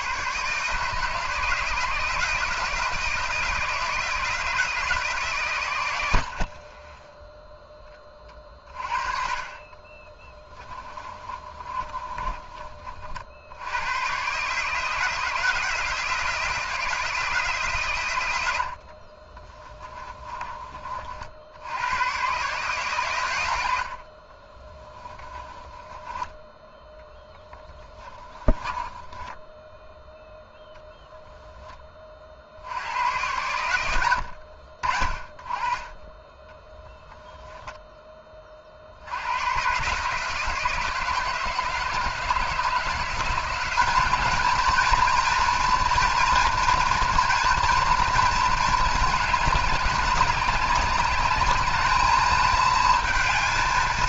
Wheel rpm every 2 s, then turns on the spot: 150, 170, 160, 30, 40, 30, 30, 150, 170, 70, 30, 130, 20, 10, 20, 10, 90, 50, 20, 50, 160, 170, 230, 230, 220, 200, 220.
10-12 18-20 24-26 28-30 36-38